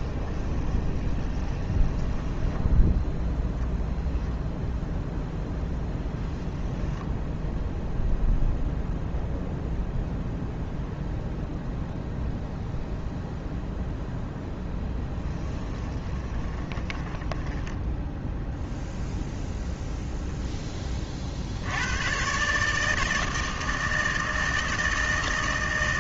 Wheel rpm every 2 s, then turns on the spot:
20, 10, 0, 10, 0, 0, 0, 10, 10, 0, 20, 150, 160.
0-4 14-18